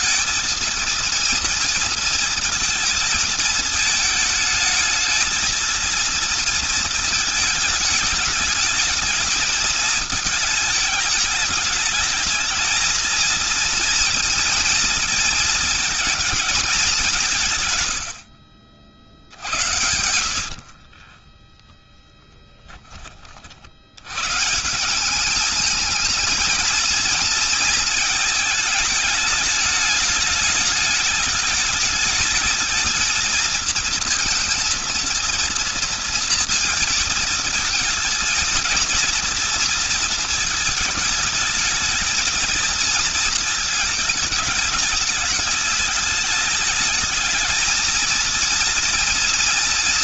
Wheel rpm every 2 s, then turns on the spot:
230, 230, 220, 230, 220, 220, 220, 230, 220, 80, 70, 20, 150, 220, 220, 220, 220, 230, 230, 220, 220, 230, 210, 210, 230.
18-24